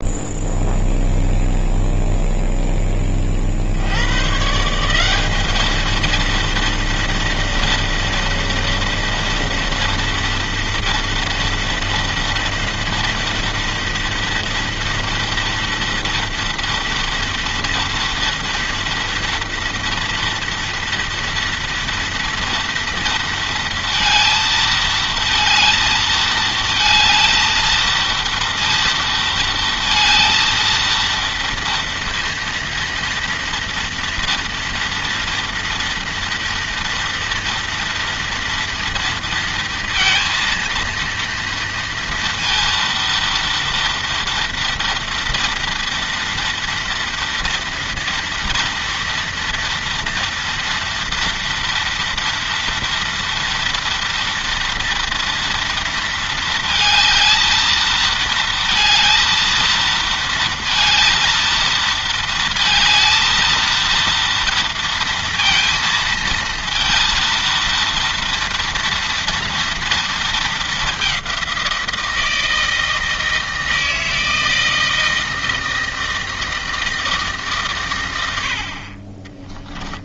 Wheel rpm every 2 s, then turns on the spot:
0, 10, 160, 230, 230, 230, 230, 230, 230, 230, 230, 240, 220, 220, 230, 230, 230, 230, 230, 230, 230, 230, 230, 230, 230, 230, 230, 230, 220, 230, 230, 230, 230, 230, 230, 210, 160, 160, 160, 60.
none